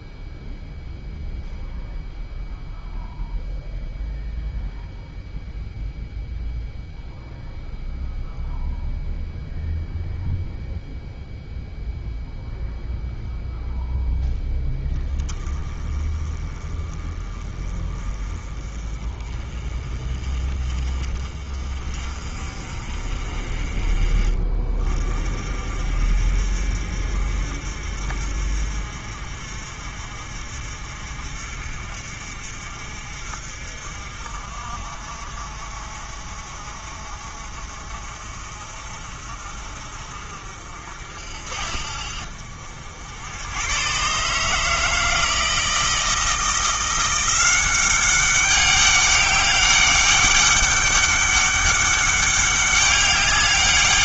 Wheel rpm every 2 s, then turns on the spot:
0, 0, 0, 0, 0, 0, 10, 20, 30, 30, 40, 30, 50, 50, 50, 50, 50, 50, 50, 50, 60, 100, 160, 180, 200, 200, 200.
none